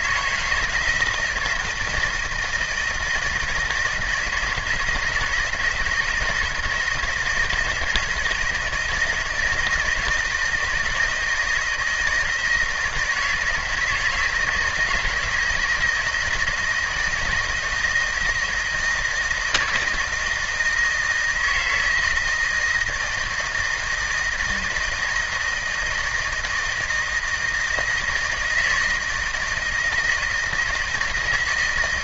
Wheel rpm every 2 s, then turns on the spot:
160, 160, 160, 160, 160, 170, 160, 160, 160, 160, 160, 160, 160, 160, 160, 160.
none